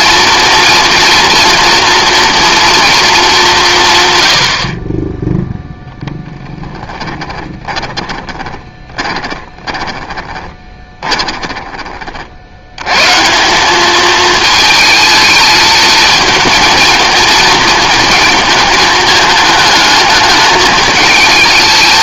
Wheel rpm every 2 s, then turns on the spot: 230, 240, 80, 20, 20, 20, 80, 220, 230, 220, 220.
6-12